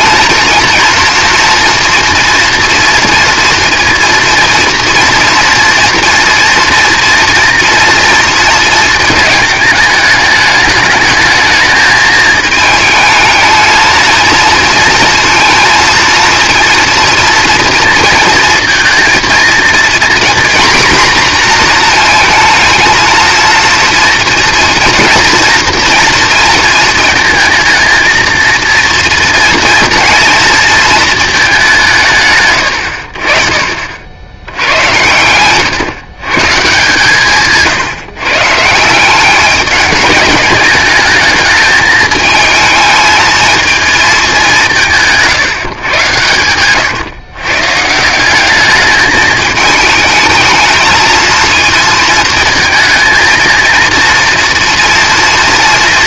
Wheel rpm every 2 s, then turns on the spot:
230, 230, 230, 230, 220, 210, 220, 230, 230, 230, 250, 220, 230, 230, 230, 230, 110, 90, 150, 160, 210, 220, 180, 110, 210, 220, 230, 230.
46-48